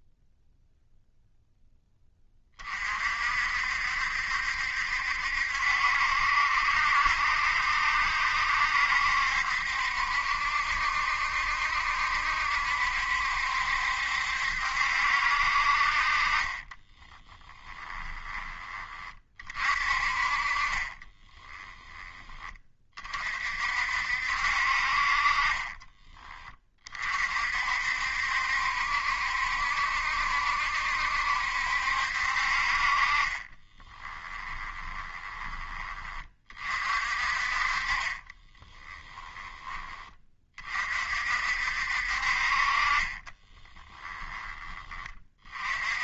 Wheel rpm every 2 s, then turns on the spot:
0, 40, 70, 70, 70, 70, 70, 70, 20, 20, 30, 30, 50, 30, 70, 70, 40, 20, 40, 20, 40, 30, 20.
16-18 20-22 34-36 38-40